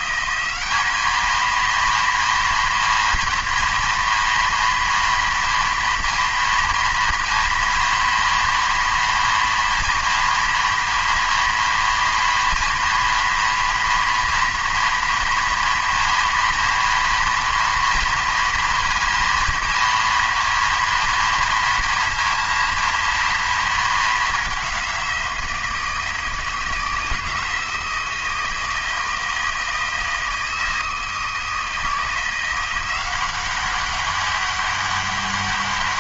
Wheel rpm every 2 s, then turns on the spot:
200, 230, 230, 230, 230, 230, 230, 240, 230, 230, 230, 230, 200, 160, 160, 160, 180, 200.
none